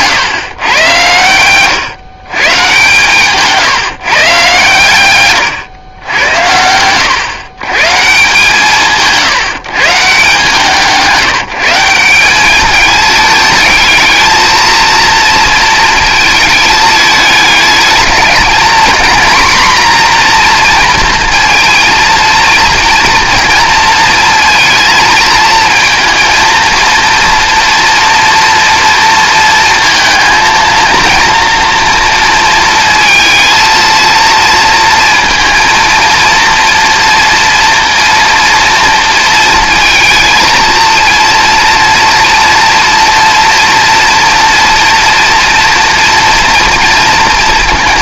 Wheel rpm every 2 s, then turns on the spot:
110, 130, 120, 110, 150, 160, 210, 230, 210, 230, 240, 230, 220, 230, 230, 230, 230, 230, 230, 230, 230, 230, 240, 230.
none